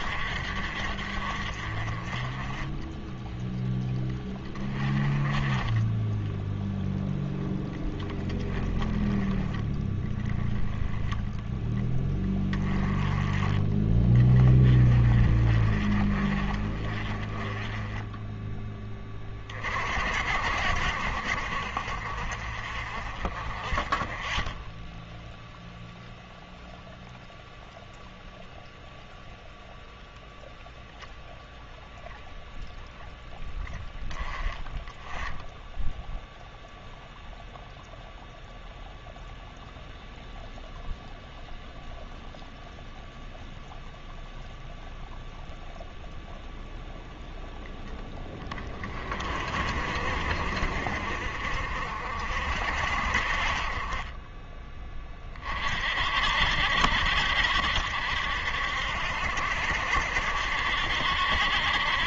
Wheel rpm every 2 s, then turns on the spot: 50, 10, 20, 0, 10, 10, 20, 30, 30, 10, 50, 40, 10, 0, 0, 0, 0, 20, 0, 0, 0, 0, 0, 0, 30, 50, 60, 20, 60, 70, 70.
none